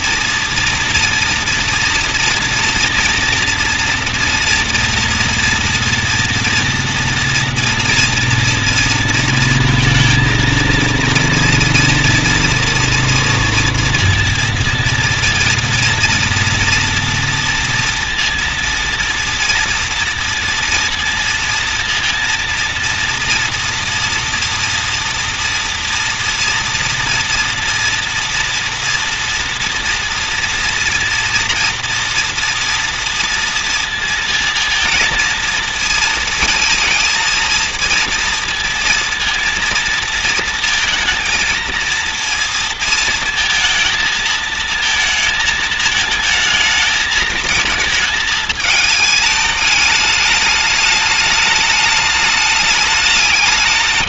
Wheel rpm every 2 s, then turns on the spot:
230, 230, 240, 230, 230, 230, 240, 230, 230, 230, 230, 230, 230, 230, 230, 230, 230, 230, 220, 230, 230, 230, 230, 220, 220, 210, 210.
none